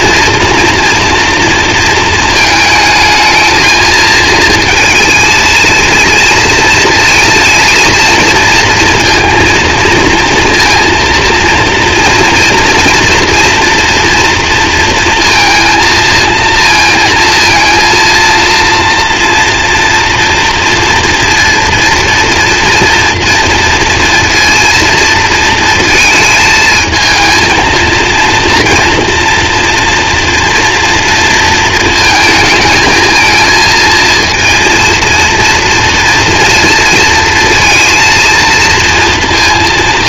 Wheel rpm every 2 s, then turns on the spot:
230, 220, 220, 230, 230, 230, 230, 230, 230, 230, 230, 230, 230, 220, 230, 230, 220, 230, 230, 230.
none